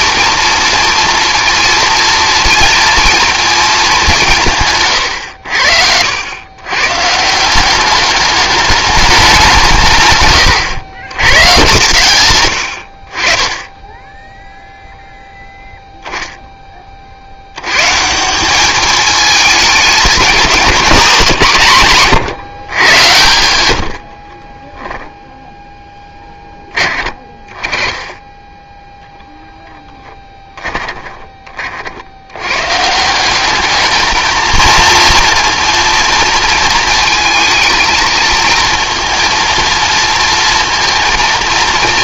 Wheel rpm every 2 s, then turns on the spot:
230, 230, 80, 170, 190, 120, 30, 0, 40, 210, 190, 110, 0, 20, 0, 10, 140, 230, 230, 230, 230.
30-32